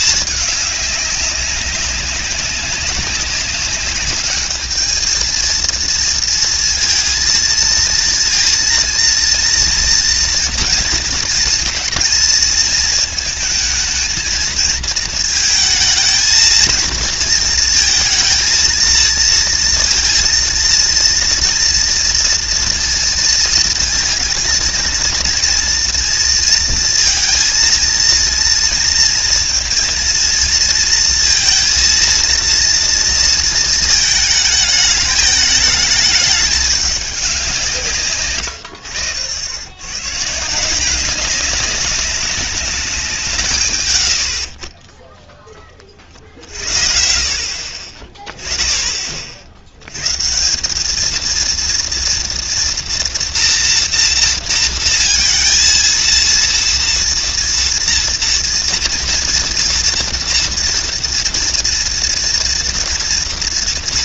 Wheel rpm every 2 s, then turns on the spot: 210, 200, 210, 230, 230, 230, 220, 220, 230, 230, 230, 240, 230, 230, 230, 220, 230, 210, 200, 100, 170, 200, 40, 60, 20, 190, 230, 230, 230, 240, 230, 240.
none